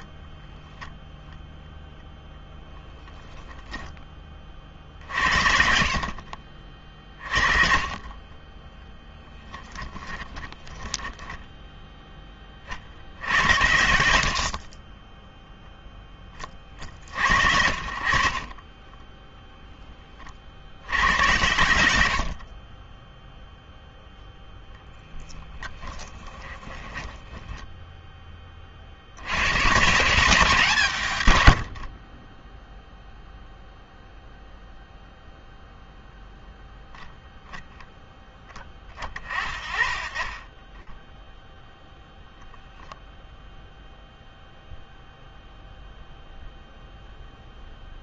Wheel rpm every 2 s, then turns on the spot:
0, 0, 40, 50, 30, 20, 40, 60, 20, 40, 50, 50, 0, 20, 30, 170, 30, 0, 0, 10, 20, 0, 0, 0.
8-12 26-28